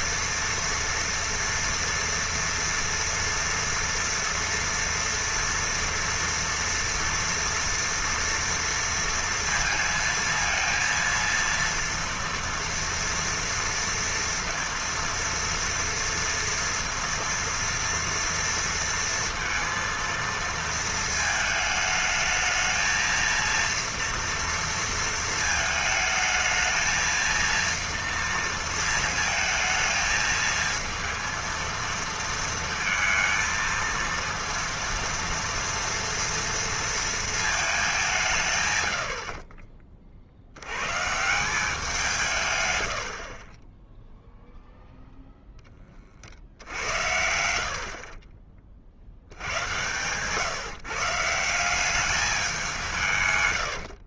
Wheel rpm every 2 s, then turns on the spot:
230, 230, 230, 230, 230, 230, 230, 230, 230, 230, 230, 220, 230, 220, 230, 220, 230, 230, 230, 130, 90, 110, 0, 80, 30, 140, 190.
none